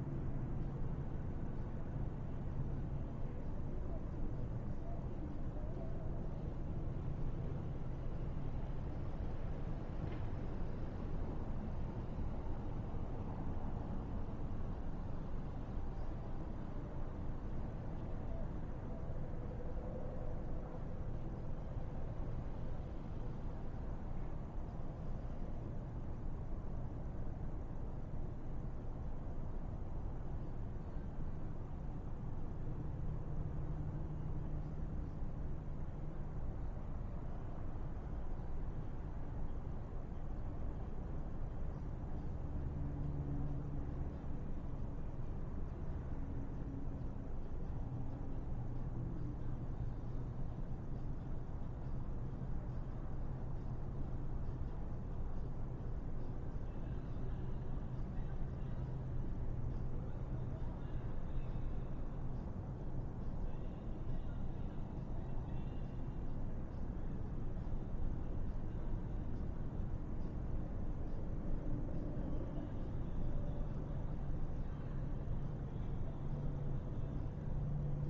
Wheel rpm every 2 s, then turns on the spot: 0, 0, 0, 0, 0, 0, 0, 0, 0, 0, 0, 0, 0, 0, 0, 0, 0, 0, 0, 0, 0, 0, 0, 0, 0, 0, 0, 0, 0, 0, 0, 0, 0, 0, 0, 0, 0, 0, 0.
none